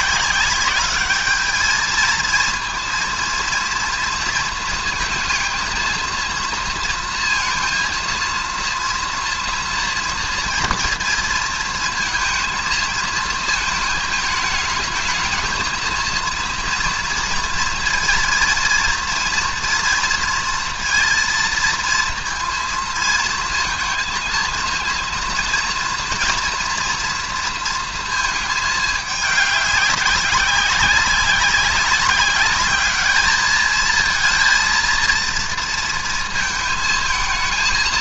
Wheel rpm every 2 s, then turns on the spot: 200, 230, 230, 230, 230, 230, 220, 220, 230, 230, 230, 230, 230, 230, 220, 200, 210, 230, 220.
none